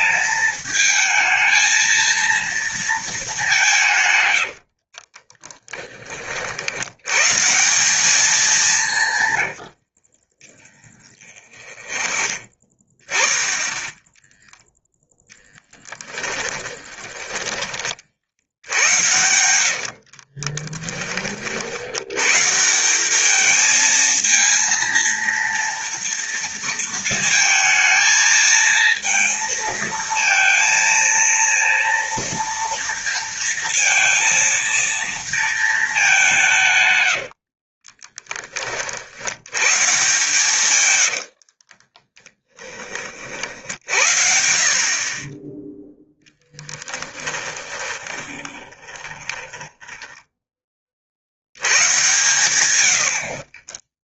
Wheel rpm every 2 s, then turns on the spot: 220, 230, 70, 70, 200, 20, 20, 0, 20, 80, 20, 160, 230, 230, 220, 230, 230, 230, 160, 30, 120, 20, 60, 10, 20, 30, 100.
4-6 10-12 16-18 20-22 40-44 46-50 52-54